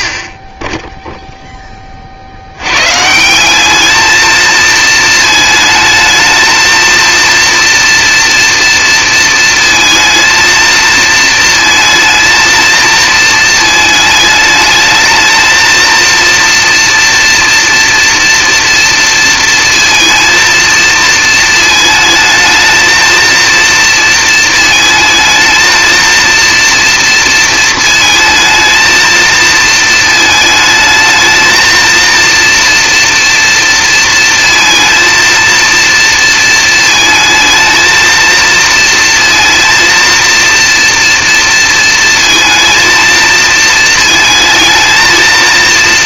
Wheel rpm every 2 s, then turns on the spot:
10, 60, 220, 220, 230, 220, 220, 220, 230, 230, 230, 220, 230, 230, 220, 220, 230, 230, 230, 230, 230, 230, 220.
none